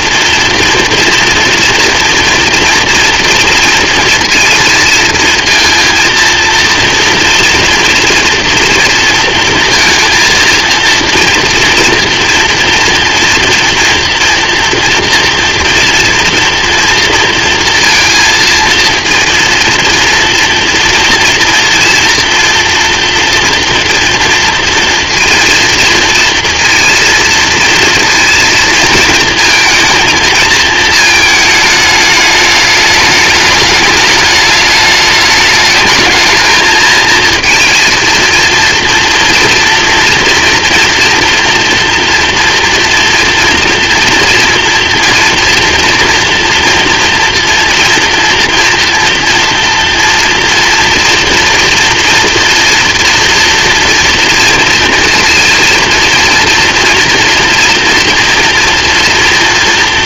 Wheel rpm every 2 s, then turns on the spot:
230, 230, 230, 230, 230, 230, 230, 230, 230, 230, 230, 230, 230, 230, 230, 230, 210, 210, 220, 230, 230, 230, 230, 240, 230, 230, 240, 230, 230, 230.
none